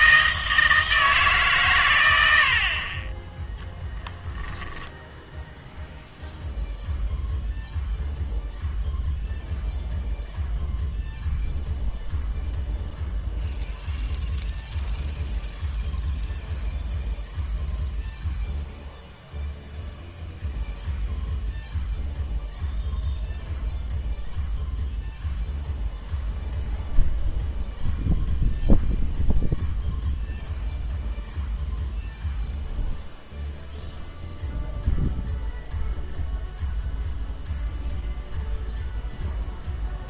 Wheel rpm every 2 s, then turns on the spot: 160, 50, 10, 0, 0, 0, 0, 0, 0, 0, 0, 0, 0, 0, 0, 0, 0, 0, 0, 0.
4-6